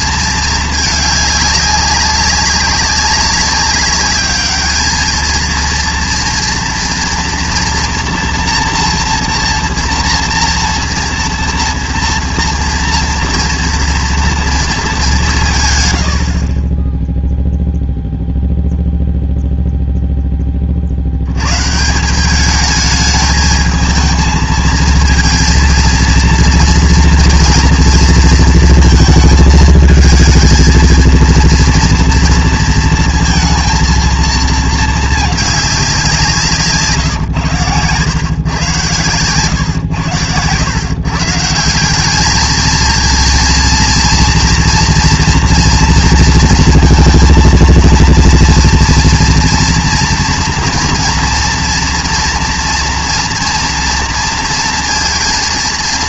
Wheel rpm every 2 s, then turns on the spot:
220, 200, 210, 240, 230, 230, 230, 230, 30, 0, 20, 210, 220, 230, 230, 220, 230, 230, 170, 120, 100, 220, 240, 230, 230, 230, 230, 230.
none